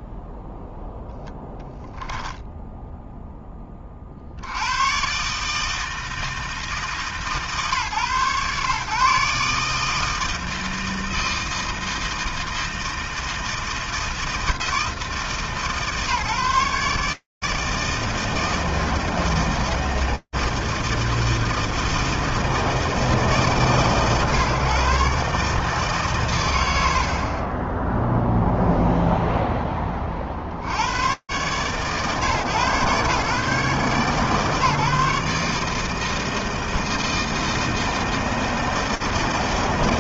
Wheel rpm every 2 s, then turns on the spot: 0, 0, 100, 160, 130, 160, 160, 160, 150, 160, 160, 150, 130, 70, 0, 50, 140, 150, 160, 160.
none